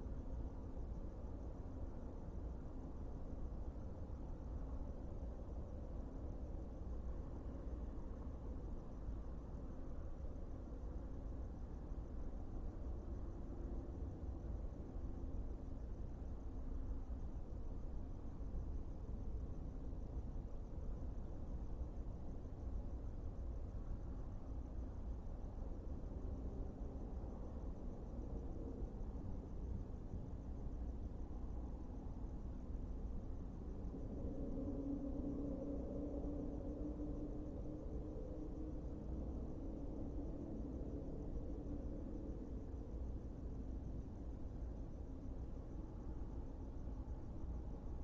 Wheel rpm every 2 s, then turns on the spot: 0, 0, 0, 0, 0, 0, 0, 0, 0, 0, 0, 0, 0, 0, 0, 0, 0, 0, 0, 0, 0, 0, 0, 0.
none